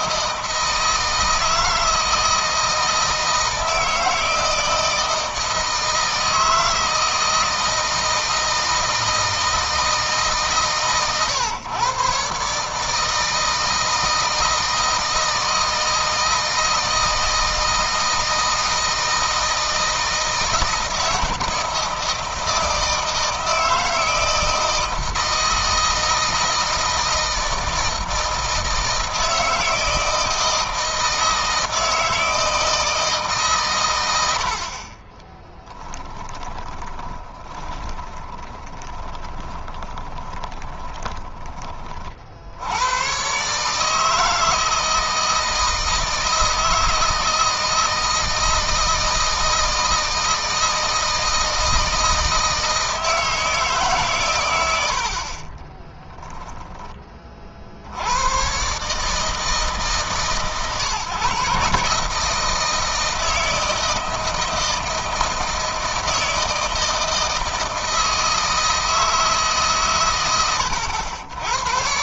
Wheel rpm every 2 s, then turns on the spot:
160, 160, 160, 160, 160, 140, 140, 160, 160, 160, 160, 160, 160, 160, 160, 160, 160, 60, 20, 20, 20, 80, 160, 160, 160, 160, 160, 90, 20, 130, 130, 160, 160, 160, 160, 100.
36-42